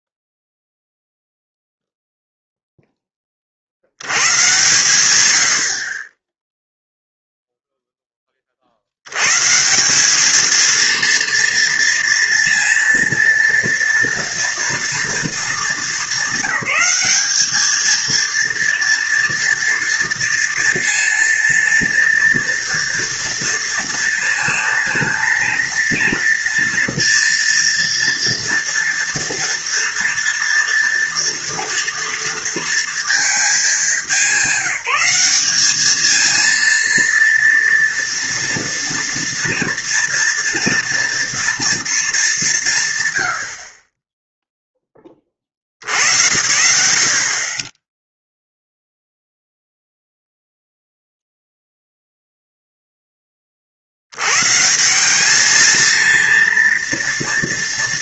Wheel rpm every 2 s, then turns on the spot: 0, 0, 100, 0, 60, 230, 230, 230, 200, 230, 230, 230, 230, 230, 230, 230, 230, 200, 230, 230, 230, 160, 10, 80, 0, 0, 0, 160, 240.
none